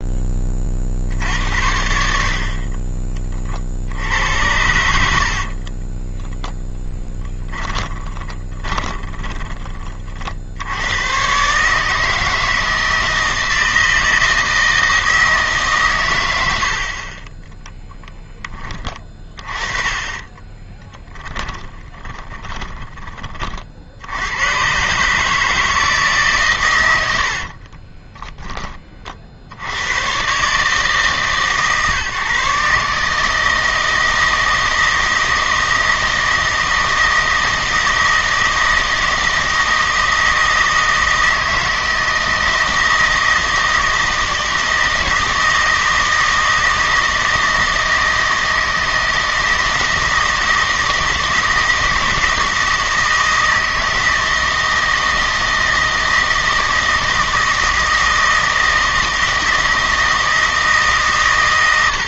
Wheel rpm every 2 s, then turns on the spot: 40, 40, 80, 10, 30, 90, 160, 160, 60, 20, 20, 20, 120, 110, 30, 140, 140, 160, 160, 160, 160, 160, 160, 160, 160, 160, 160, 160, 160, 160, 150.
2-4 8-10 20-24